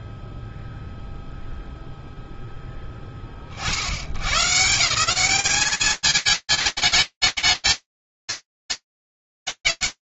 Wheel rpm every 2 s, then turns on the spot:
0, 0, 140, 220, 220.
none